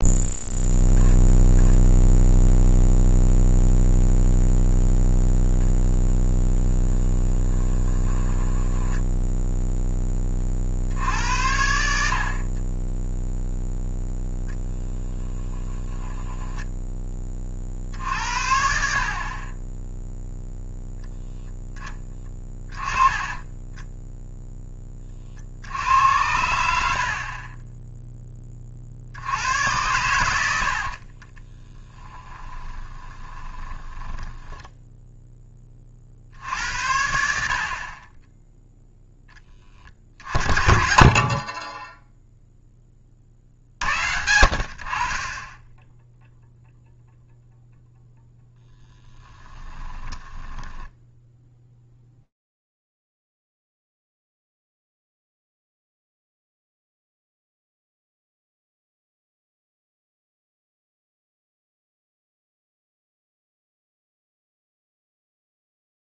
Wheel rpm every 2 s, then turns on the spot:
0, 0, 0, 20, 10, 50, 30, 0, 10, 60, 0, 10, 0, 80, 40, 60, 30, 10, 70, 0, 50, 10, 60, 0, 10, 10, 0, 0, 110, 90, 80, 0, 0.
6-10 30-36 40-42 50-52